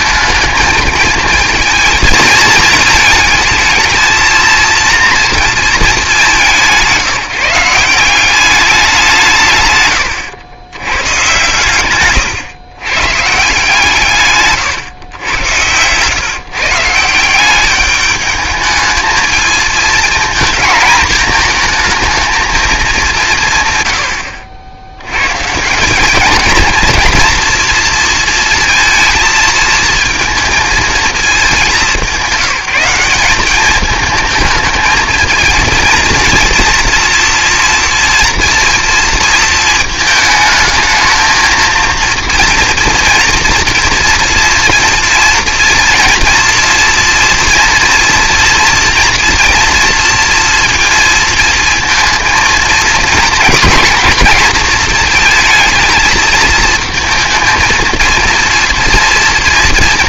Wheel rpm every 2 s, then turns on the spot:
220, 220, 230, 170, 200, 100, 120, 140, 150, 210, 230, 220, 70, 230, 230, 230, 180, 220, 230, 230, 220, 230, 240, 230, 230, 230, 230, 230, 220, 230.
none